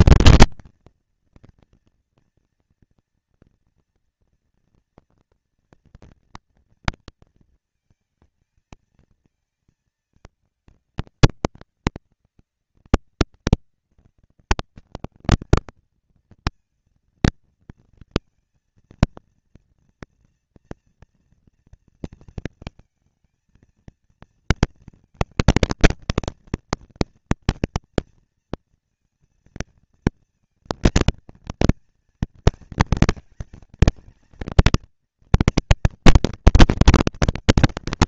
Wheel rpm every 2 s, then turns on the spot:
230, 230, 230, 230, 230, 210, 190, 200, 230, 230, 240, 220, 230, 230, 230, 230, 220, 230, 220.
none